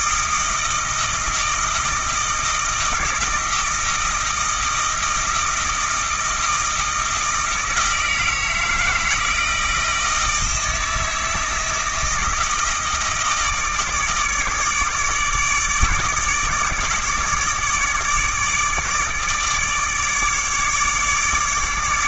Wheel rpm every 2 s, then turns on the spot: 160, 160, 160, 160, 160, 160, 160, 150, 150, 150, 150.
none